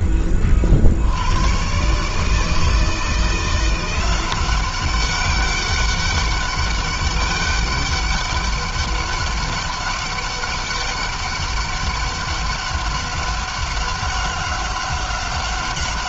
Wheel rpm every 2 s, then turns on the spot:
60, 160, 190, 200, 200, 200, 200, 190.
none